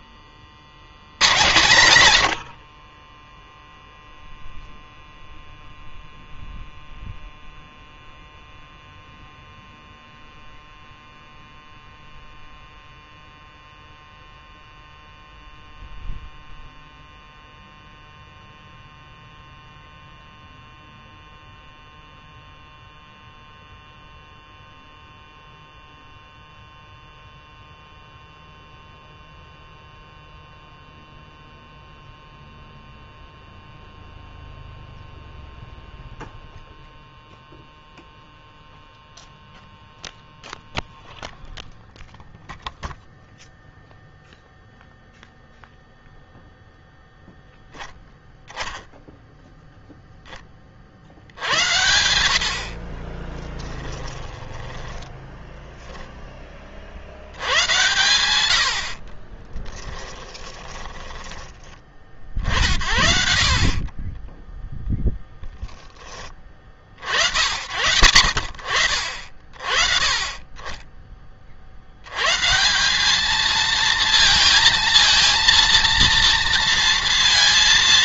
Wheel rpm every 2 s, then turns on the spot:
80, 60, 0, 0, 0, 0, 0, 0, 0, 0, 0, 0, 0, 0, 0, 0, 0, 0, 0, 0, 0, 0, 0, 0, 0, 40, 50, 20, 50, 70, 10, 40, 10, 40, 60, 30, 160, 220, 230.
52-56 58-62